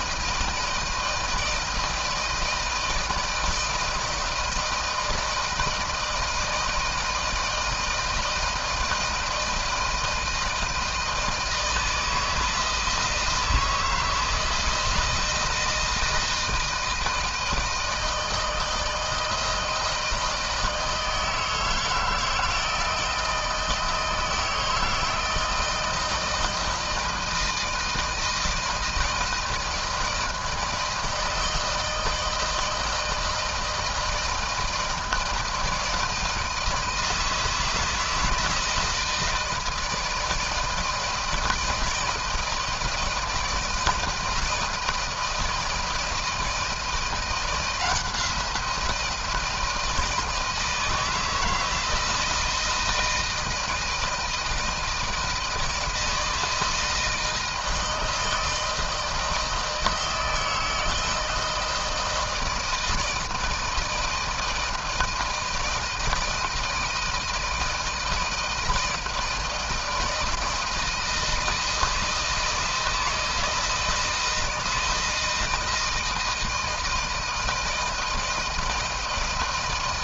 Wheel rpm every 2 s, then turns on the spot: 160, 160, 160, 160, 160, 160, 160, 160, 160, 160, 160, 160, 160, 160, 170, 160, 160, 160, 160, 160, 160, 160, 170, 160, 170, 160, 160, 160, 160, 160, 160, 160, 160, 160, 160, 160, 160, 160, 160, 160.
none